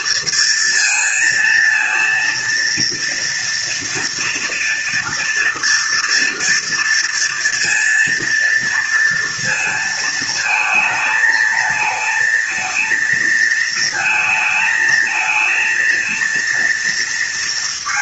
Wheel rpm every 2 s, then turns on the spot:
230, 230, 230, 230, 230, 220, 220, 220, 230.
none